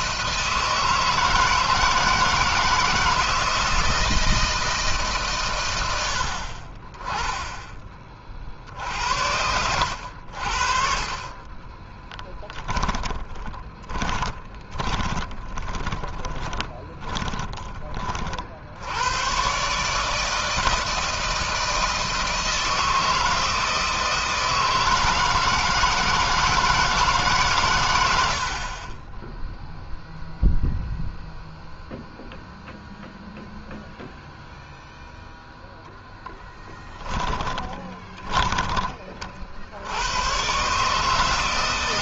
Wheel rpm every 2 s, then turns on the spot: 160, 160, 160, 50, 50, 50, 10, 20, 30, 70, 160, 160, 160, 160, 60, 0, 0, 0, 10, 20, 120.
12-18 36-38